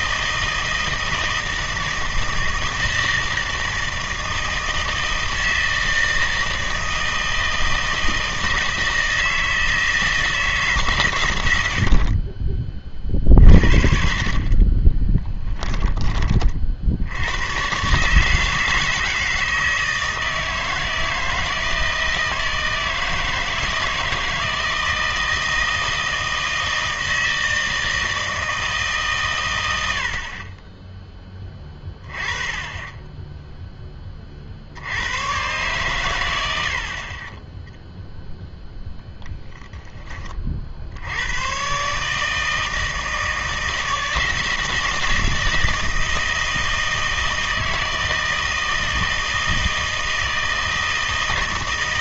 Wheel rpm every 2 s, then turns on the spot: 160, 160, 160, 160, 160, 150, 30, 20, 50, 160, 160, 160, 160, 160, 150, 10, 20, 70, 60, 0, 60, 160, 160, 160, 160, 160.
14-16